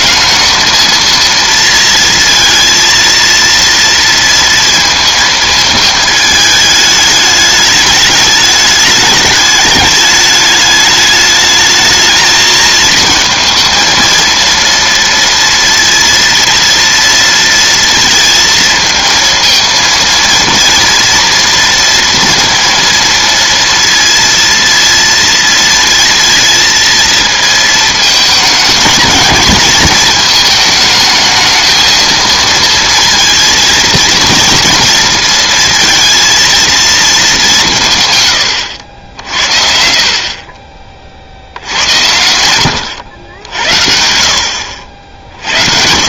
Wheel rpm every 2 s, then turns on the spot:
220, 230, 230, 220, 210, 210, 220, 230, 230, 230, 230, 230, 230, 230, 220, 220, 230, 230, 230, 110, 30, 90, 70.
none